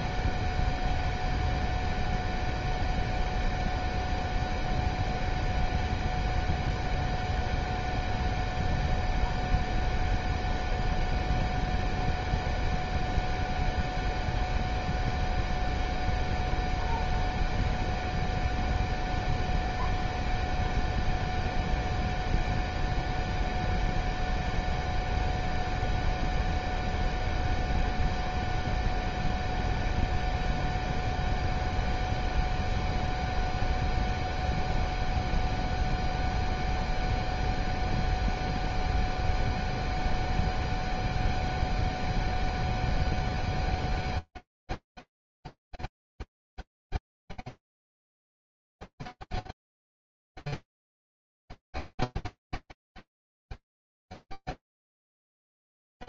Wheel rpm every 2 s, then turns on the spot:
0, 0, 0, 0, 0, 0, 0, 0, 0, 0, 0, 0, 0, 0, 0, 0, 0, 0, 0, 0, 0, 0, 0, 0, 0, 0, 0, 0.
none